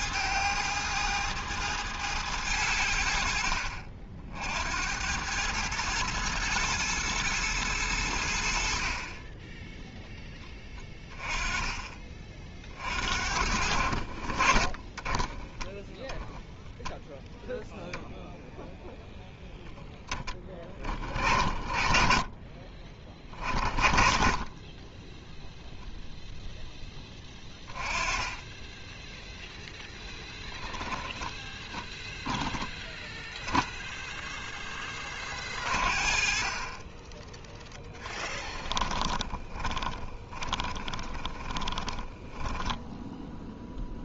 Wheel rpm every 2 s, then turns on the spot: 110, 90, 80, 110, 60, 10, 40, 30, 0, 0, 30, 30, 20, 10, 10, 10, 10, 10, 30, 20, 20, 10.
38-42